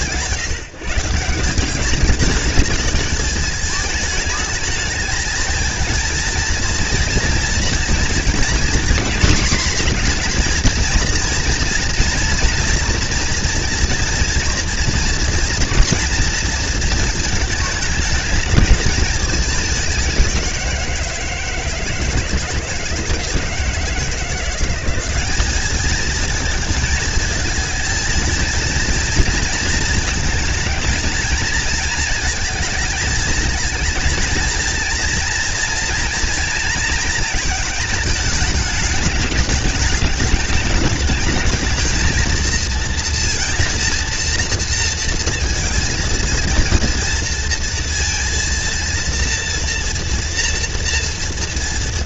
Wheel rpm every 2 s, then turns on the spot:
170, 210, 210, 230, 240, 240, 240, 240, 230, 220, 180, 160, 180, 230, 230, 220, 220, 230, 230, 220, 210, 230, 230, 230, 230, 230.
none